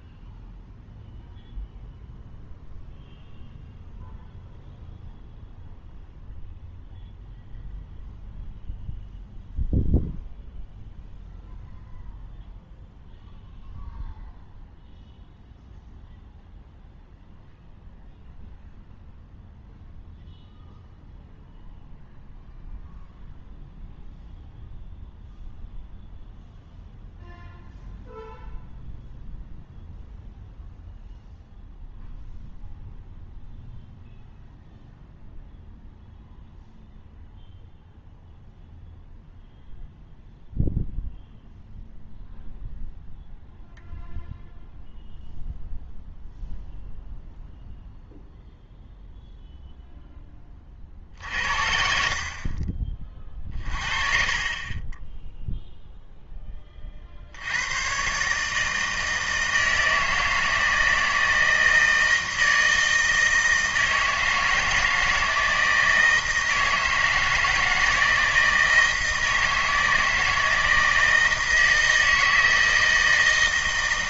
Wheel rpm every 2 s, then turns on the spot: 0, 0, 0, 0, 0, 0, 0, 0, 0, 0, 0, 0, 0, 0, 0, 0, 0, 0, 0, 0, 0, 0, 0, 0, 0, 30, 50, 30, 20, 150, 160, 160, 160, 160, 160, 160, 160.
52-54